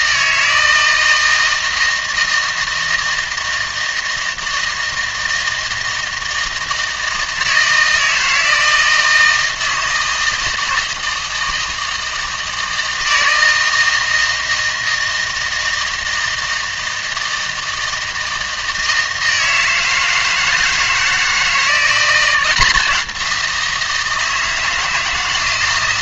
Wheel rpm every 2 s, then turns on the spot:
160, 160, 160, 160, 160, 160, 160, 160, 160, 160, 160, 180, 160.
none